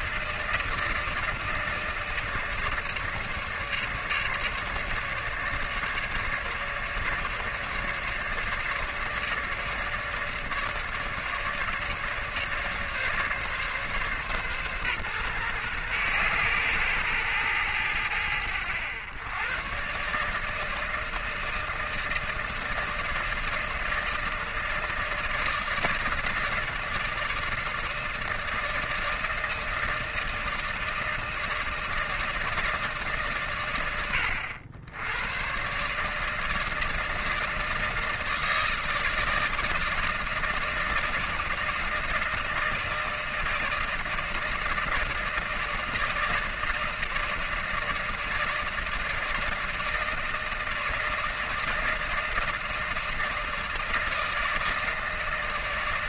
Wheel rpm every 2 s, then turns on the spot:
160, 150, 150, 150, 150, 150, 150, 130, 120, 100, 160, 160, 160, 160, 160, 160, 150, 90, 160, 160, 160, 160, 160, 160, 160, 160, 160, 160.
none